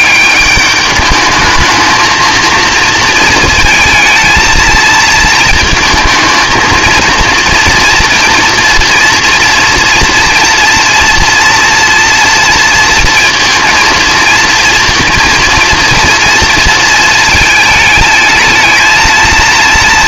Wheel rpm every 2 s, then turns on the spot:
200, 230, 220, 220, 240, 230, 230, 230, 230, 220.
none